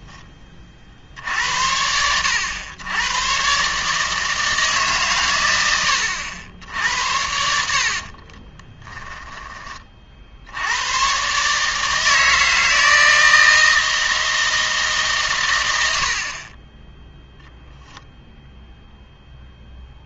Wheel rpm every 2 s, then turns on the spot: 40, 100, 150, 80, 20, 90, 160, 160, 20, 0.
8-10